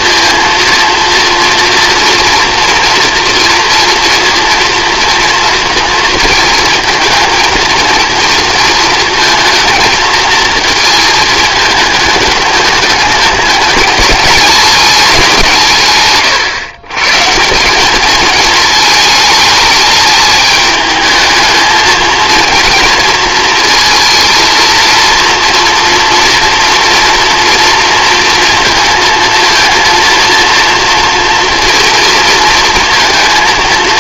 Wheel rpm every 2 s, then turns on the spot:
230, 240, 230, 220, 230, 220, 210, 220, 130, 220, 210, 220, 230, 240, 230, 230, 230.
none